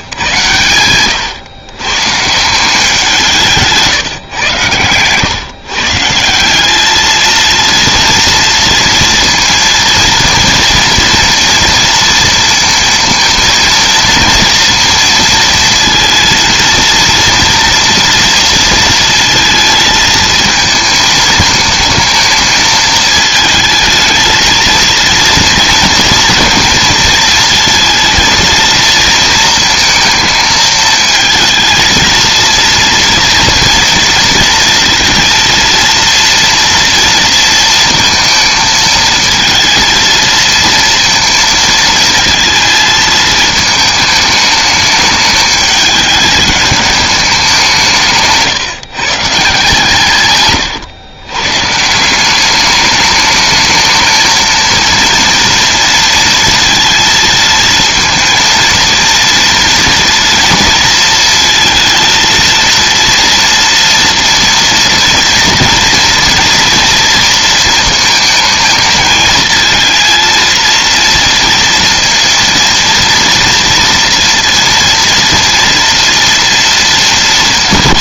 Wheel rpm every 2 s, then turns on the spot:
110, 170, 120, 200, 230, 230, 230, 230, 230, 230, 220, 220, 220, 230, 230, 220, 230, 230, 230, 220, 230, 220, 210, 210, 150, 120, 200, 230, 230, 230, 230, 230, 230, 240, 220, 230, 230, 230, 230.
50-52